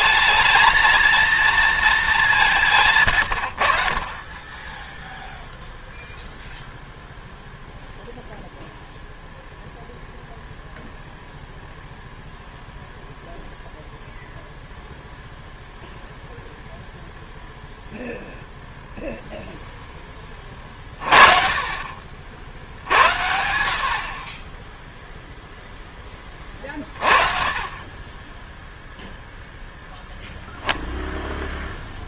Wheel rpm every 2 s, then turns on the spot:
220, 170, 20, 0, 0, 0, 0, 0, 0, 0, 30, 60, 20, 30, 0, 0.
none